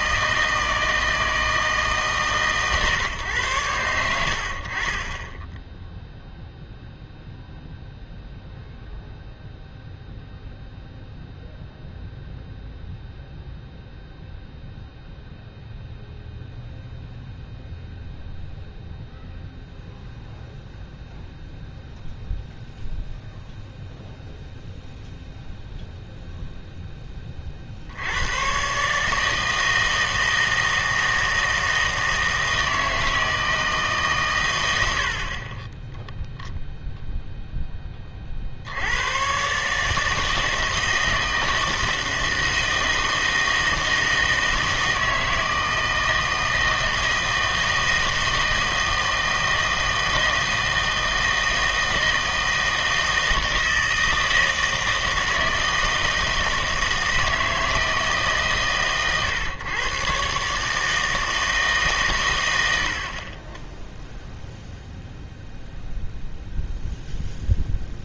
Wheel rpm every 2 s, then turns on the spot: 160, 140, 60, 0, 0, 0, 0, 0, 0, 0, 0, 0, 0, 0, 120, 160, 160, 100, 0, 70, 160, 160, 160, 160, 160, 160, 160, 160, 160, 130, 140, 90, 0, 0.
none